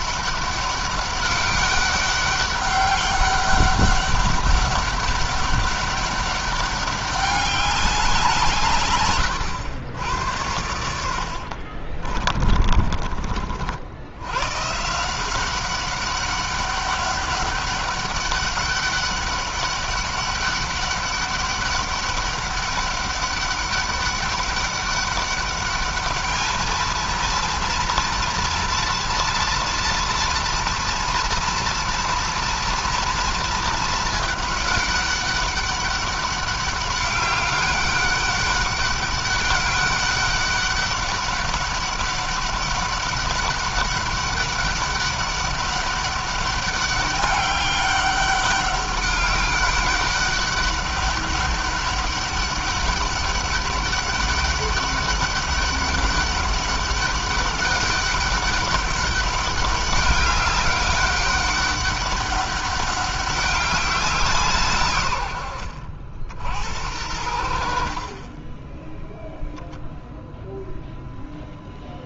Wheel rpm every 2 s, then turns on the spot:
200, 200, 200, 200, 120, 80, 40, 170, 200, 200, 200, 200, 200, 230, 230, 230, 230, 200, 200, 200, 200, 200, 200, 200, 200, 200, 200, 200, 200, 200, 200, 200, 120, 80, 0, 0.
10-12